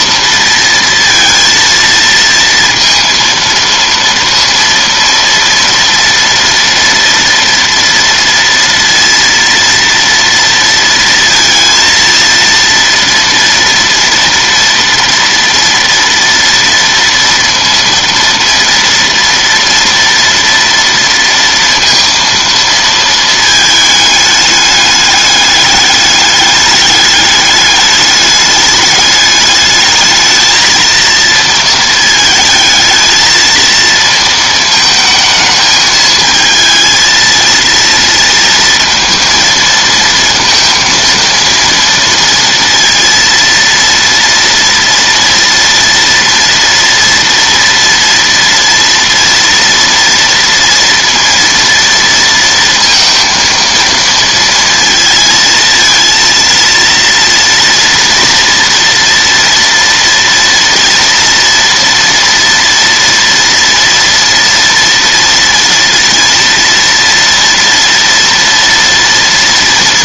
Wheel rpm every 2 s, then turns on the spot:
230, 230, 230, 230, 230, 230, 230, 230, 230, 230, 230, 230, 210, 200, 210, 220, 220, 220, 220, 230, 230, 230, 230, 230, 230, 230, 230, 230, 230, 230, 230, 230, 230, 230, 230.
none